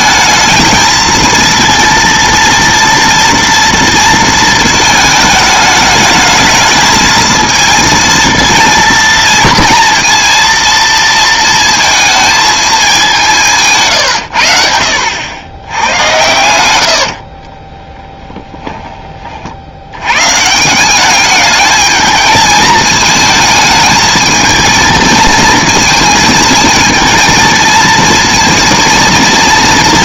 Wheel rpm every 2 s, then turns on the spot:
220, 230, 230, 220, 230, 230, 220, 80, 90, 10, 150, 210, 220, 220, 230.
16-20